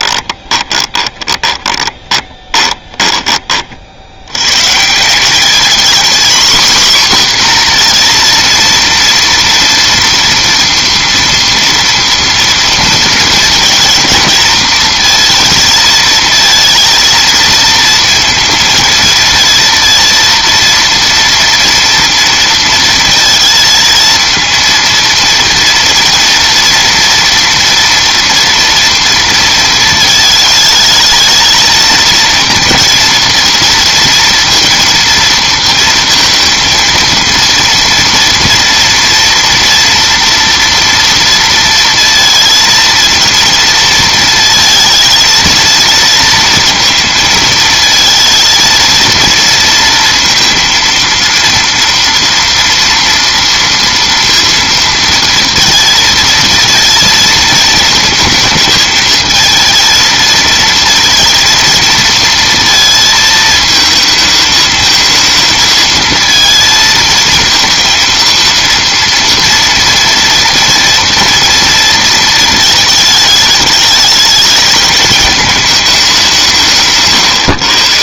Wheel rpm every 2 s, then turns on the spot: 20, 20, 150, 250, 230, 230, 230, 230, 230, 230, 230, 230, 230, 230, 230, 220, 230, 230, 230, 230, 230, 230, 220, 220, 230, 230, 230, 230, 230, 220, 230, 230, 220, 220, 230, 230, 220, 220, 150.
0-4